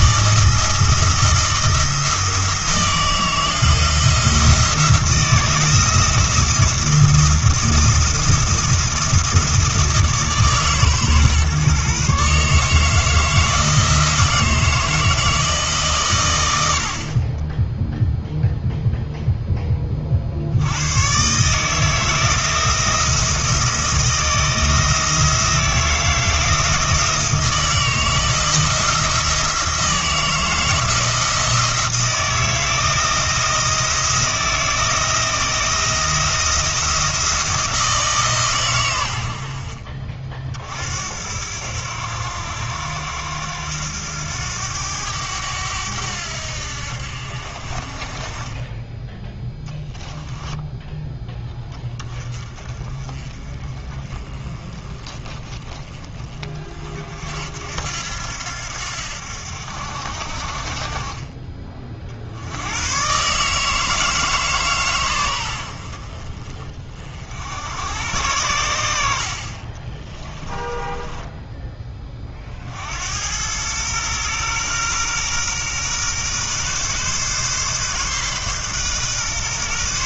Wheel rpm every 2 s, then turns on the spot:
160, 160, 170, 170, 170, 150, 150, 160, 70, 0, 90, 160, 160, 160, 160, 160, 160, 160, 170, 110, 60, 90, 90, 70, 20, 10, 30, 20, 40, 80, 40, 110, 140, 40, 80, 20, 70, 120, 130, 130.
70-72